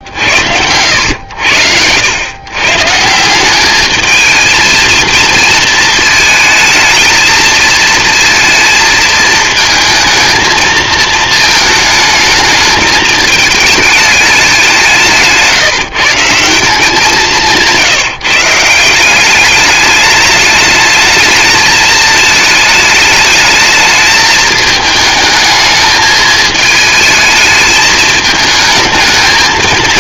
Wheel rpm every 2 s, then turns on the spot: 80, 130, 230, 220, 230, 220, 220, 200, 170, 150, 210, 220, 210, 220, 210.
none